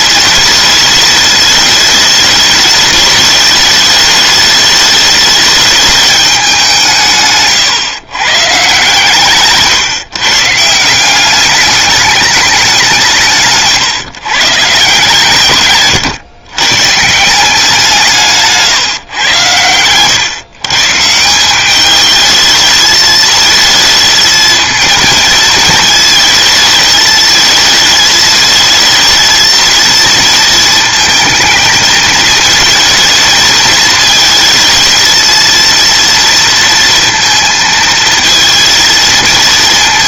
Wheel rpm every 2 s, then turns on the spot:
210, 210, 210, 170, 150, 170, 190, 140, 130, 150, 140, 220, 230, 220, 220, 220, 220, 220, 230, 230.
none